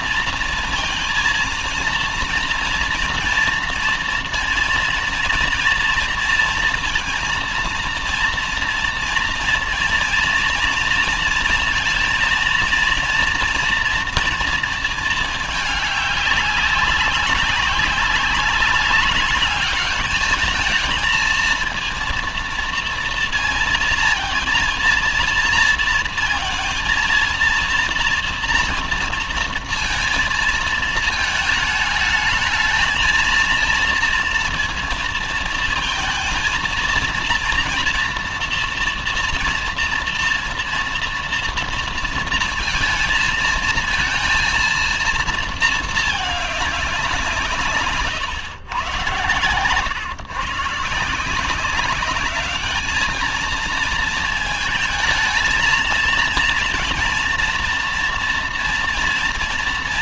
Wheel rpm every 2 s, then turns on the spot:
230, 230, 230, 230, 230, 230, 230, 230, 200, 200, 210, 230, 230, 230, 230, 230, 220, 230, 230, 230, 230, 230, 230, 210, 120, 140, 210, 220, 230, 230.
none